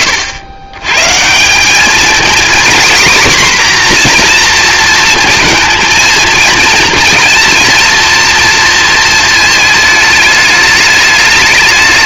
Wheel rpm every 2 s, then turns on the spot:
100, 250, 230, 230, 230, 210.
none